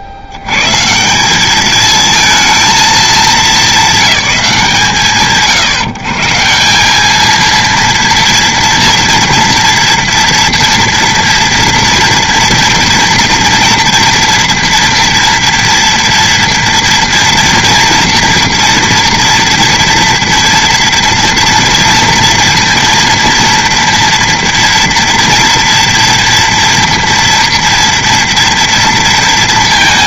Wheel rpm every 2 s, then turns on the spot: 80, 220, 140, 160, 230, 230, 230, 230, 240, 230, 240, 230, 230, 230, 230.
none